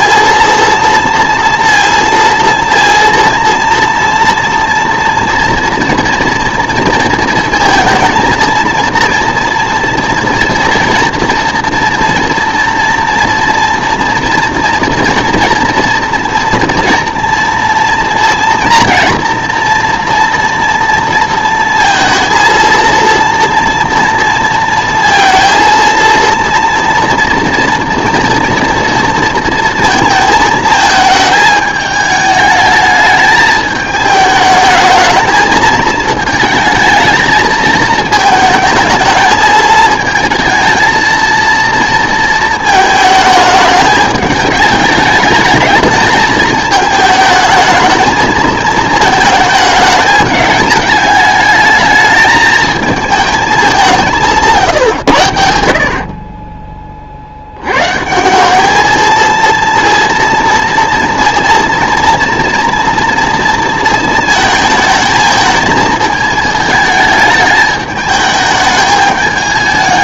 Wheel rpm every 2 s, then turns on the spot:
230, 230, 230, 230, 230, 230, 230, 230, 230, 230, 230, 230, 230, 230, 230, 220, 210, 220, 220, 220, 230, 220, 210, 220, 220, 210, 220, 120, 40, 220, 230, 230, 220, 220, 210.
none